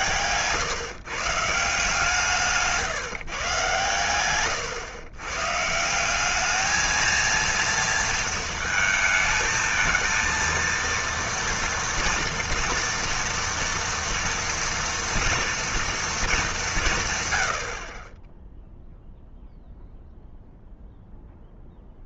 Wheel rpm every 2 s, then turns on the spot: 140, 140, 110, 210, 230, 230, 230, 230, 200, 0, 0.
0-2